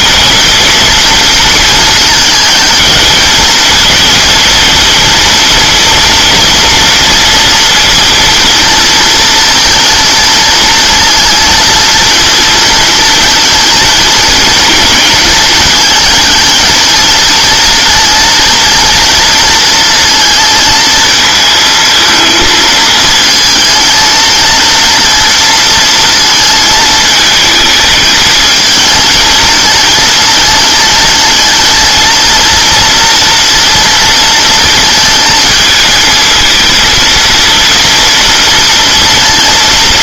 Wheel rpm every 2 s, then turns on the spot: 230, 220, 230, 230, 230, 230, 230, 230, 220, 230, 230, 220, 230, 220, 220, 220, 230, 230, 220, 230.
none